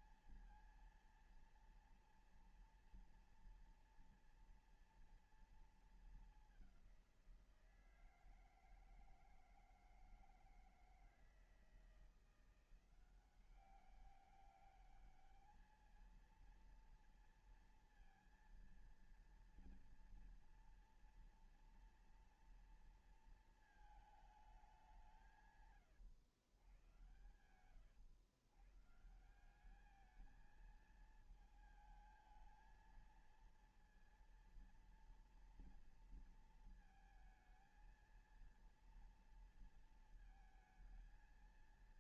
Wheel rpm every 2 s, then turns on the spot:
230, 230, 240, 210, 160, 160, 170, 200, 230, 230, 230, 230, 210, 100, 120, 210, 220, 230, 230, 230, 220.
26-28